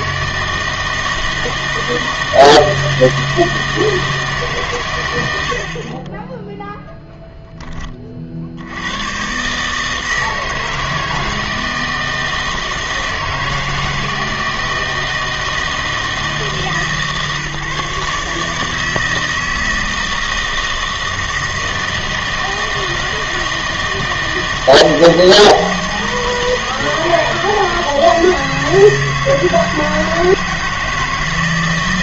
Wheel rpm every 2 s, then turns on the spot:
160, 160, 130, 0, 80, 160, 160, 160, 150, 160, 160, 160, 160, 160, 160, 160.
none